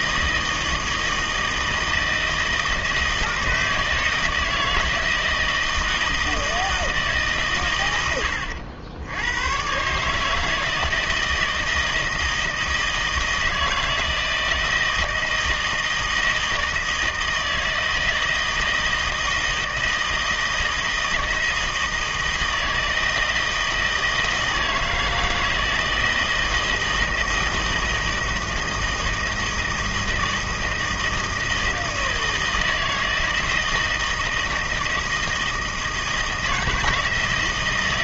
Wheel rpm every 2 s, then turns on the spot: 160, 160, 160, 160, 80, 160, 160, 160, 160, 160, 160, 160, 160, 160, 160, 160, 160, 160, 160.
none